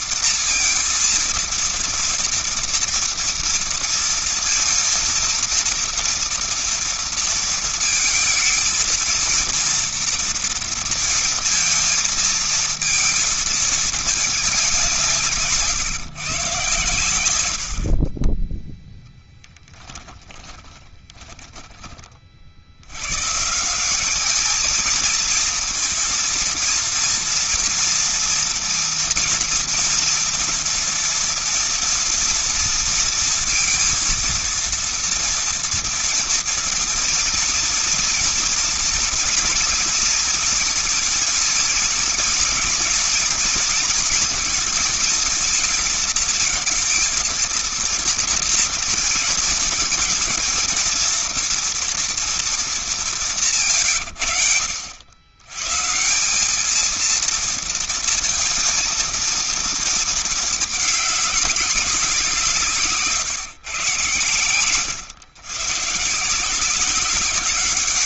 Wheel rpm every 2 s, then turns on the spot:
230, 240, 230, 230, 220, 230, 230, 200, 120, 20, 10, 50, 210, 230, 230, 230, 230, 230, 230, 230, 230, 240, 230, 230, 230, 230, 230, 90, 180, 230, 220, 180, 110, 160.
20-22